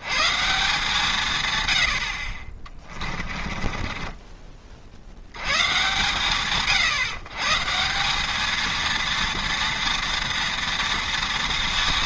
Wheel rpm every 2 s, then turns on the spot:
150, 30, 100, 130, 230, 230.
2-4